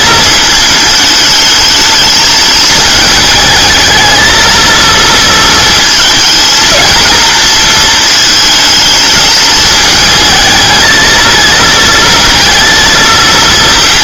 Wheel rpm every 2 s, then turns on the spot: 220, 220, 230, 230, 220, 220, 230.
none